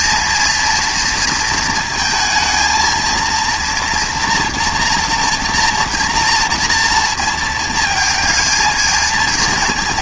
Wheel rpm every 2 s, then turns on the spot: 230, 220, 230, 240, 220.
none